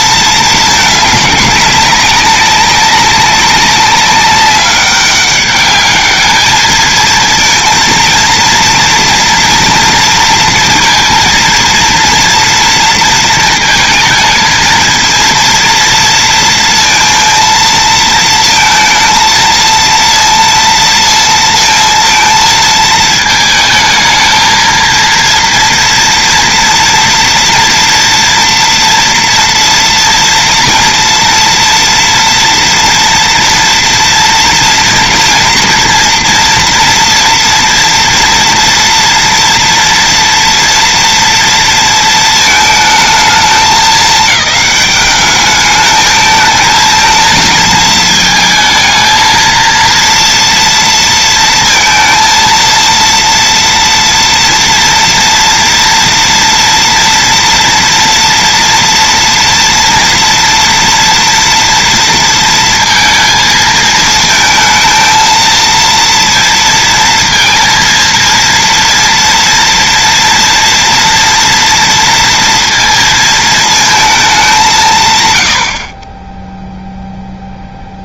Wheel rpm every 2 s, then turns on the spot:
220, 200, 200, 220, 230, 230, 230, 230, 230, 230, 230, 220, 230, 230, 230, 230, 230, 230, 230, 230, 230, 220, 210, 220, 220, 230, 230, 230, 240, 230, 240, 230, 220, 230, 230, 230, 230, 190, 0.
none